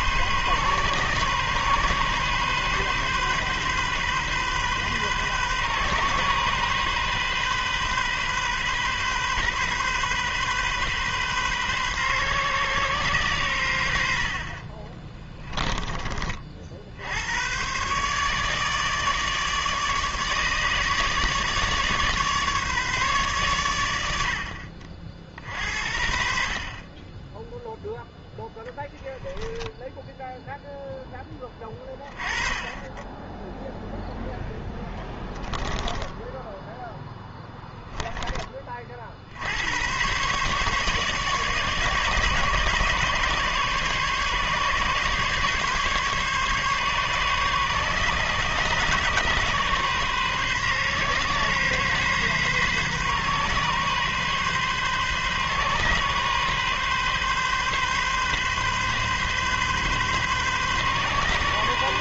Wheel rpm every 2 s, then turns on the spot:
130, 130, 130, 130, 130, 130, 130, 40, 50, 150, 150, 140, 50, 40, 10, 0, 20, 10, 0, 40, 140, 140, 140, 140, 130, 130, 130, 130, 130, 130, 130.
14-16 34-36